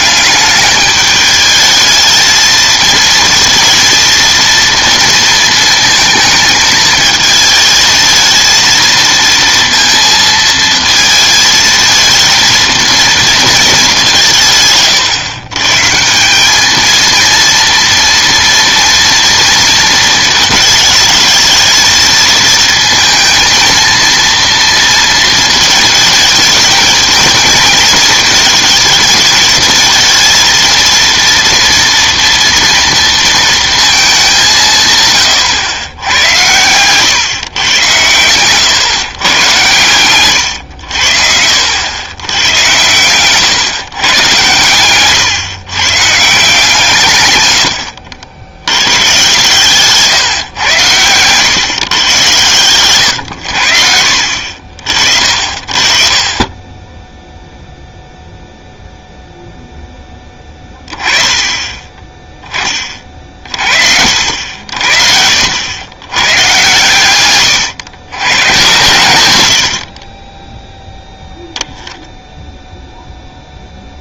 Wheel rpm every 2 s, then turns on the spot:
210, 220, 230, 220, 230, 230, 230, 150, 210, 230, 220, 230, 230, 220, 220, 230, 230, 170, 110, 120, 100, 110, 110, 160, 100, 120, 110, 50, 10, 0, 20, 20, 70, 120, 100, 10, 0.
52-54